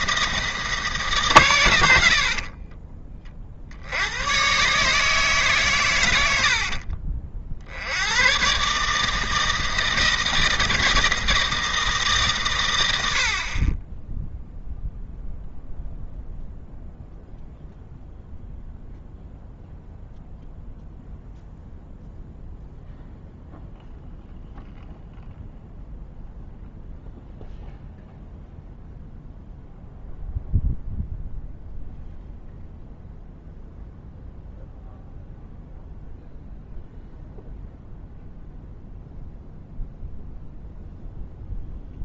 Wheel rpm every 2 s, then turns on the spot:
160, 40, 140, 60, 130, 160, 120, 0, 0, 0, 0, 0, 0, 0, 0, 0, 0, 0, 0, 0, 0.
2-4 6-8